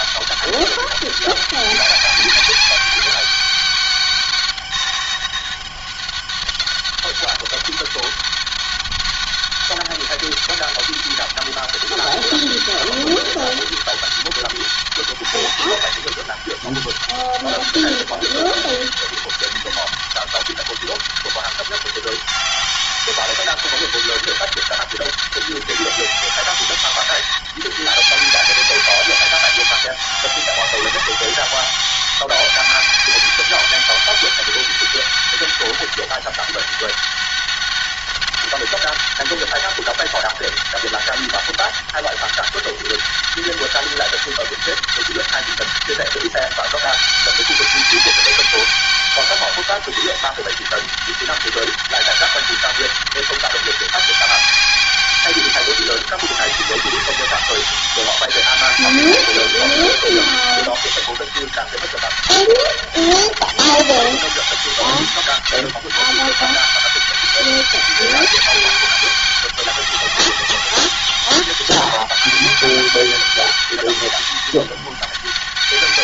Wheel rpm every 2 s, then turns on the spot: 200, 200, 200, 200, 200, 200, 200, 200, 200, 200, 200, 200, 200, 200, 200, 200, 190, 200, 200, 200, 200, 200, 200, 200, 200, 200, 200, 200, 190, 200, 200, 190, 200, 200, 200, 200, 200, 200.
none